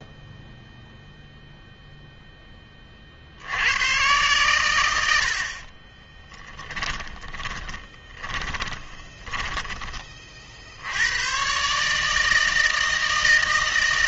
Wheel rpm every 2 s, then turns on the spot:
0, 30, 100, 20, 20, 70, 160.
6-10